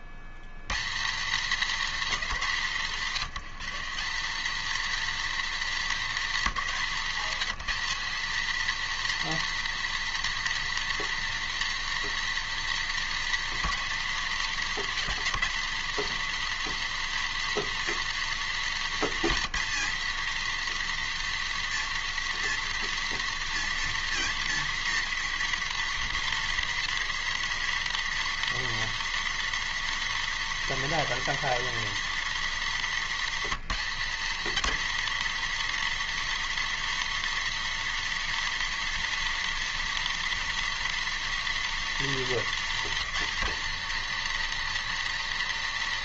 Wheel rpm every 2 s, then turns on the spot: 160, 180, 240, 210, 240, 240, 230, 220, 240, 230, 240, 240, 240, 240, 240, 240, 230, 240, 240, 240, 240, 230, 240.
none